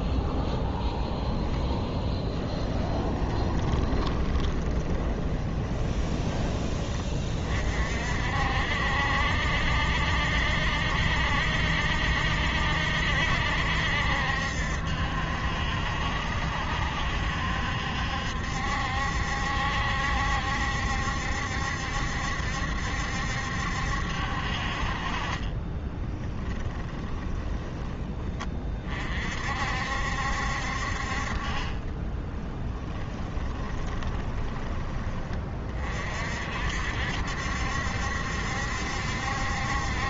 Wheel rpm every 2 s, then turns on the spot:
0, 20, 20, 30, 70, 70, 70, 70, 70, 70, 70, 70, 50, 20, 30, 50, 20, 20, 60, 70.
2-6 26-28 32-34